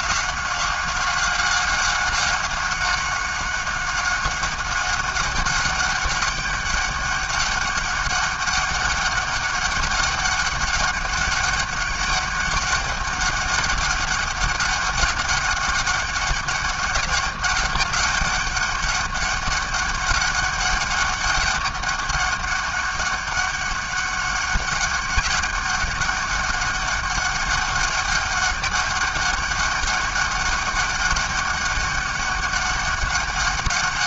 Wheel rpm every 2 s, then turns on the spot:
190, 190, 200, 200, 200, 200, 200, 200, 200, 200, 200, 200, 190, 200, 200, 200, 200.
none